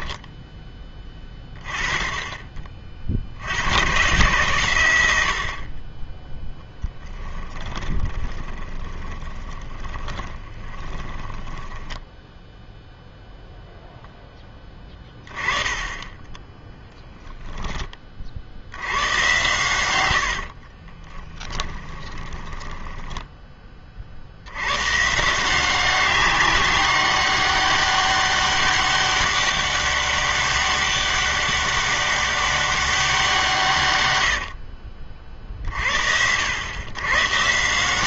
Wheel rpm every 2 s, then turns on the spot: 10, 20, 110, 0, 20, 20, 0, 10, 10, 80, 40, 10, 110, 200, 200, 200, 200, 60, 90.
8-12 20-24 34-36